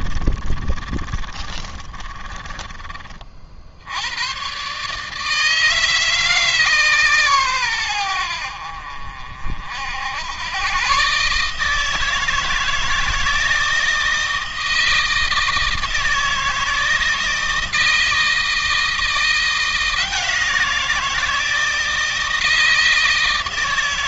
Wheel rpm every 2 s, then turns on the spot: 30, 30, 140, 140, 50, 130, 160, 160, 160, 170, 170, 160.
0-2